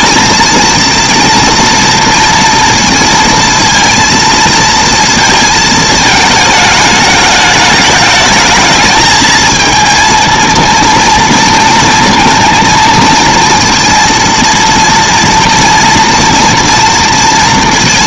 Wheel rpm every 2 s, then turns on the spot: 230, 230, 230, 220, 220, 230, 230, 230, 230.
none